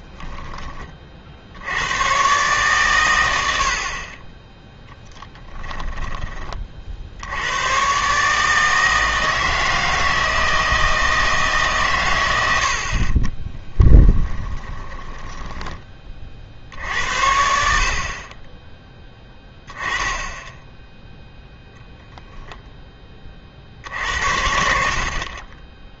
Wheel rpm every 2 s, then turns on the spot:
30, 120, 10, 40, 160, 160, 70, 20, 60, 10, 0, 10, 60.
14-16